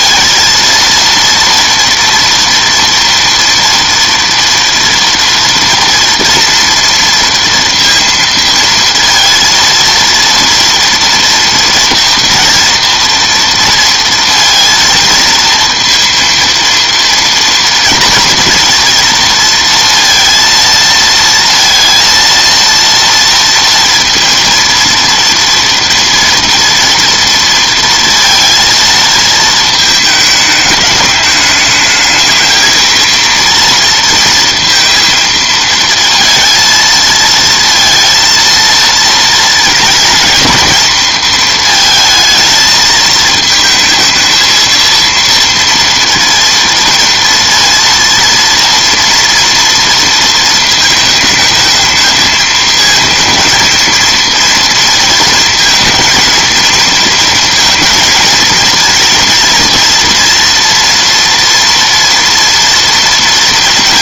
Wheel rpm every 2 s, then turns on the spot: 230, 230, 230, 230, 230, 230, 230, 230, 230, 230, 230, 230, 230, 230, 230, 210, 220, 230, 230, 230, 230, 220, 230, 230, 230, 220, 220, 230, 230, 230, 230, 240.
none